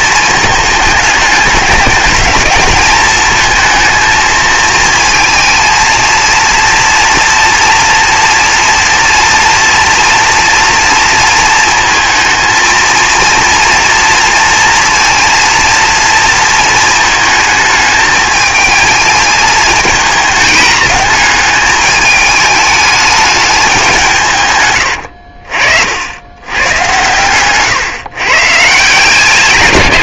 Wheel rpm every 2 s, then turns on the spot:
210, 220, 230, 240, 230, 230, 230, 230, 220, 220, 210, 210, 70, 130, 160.
none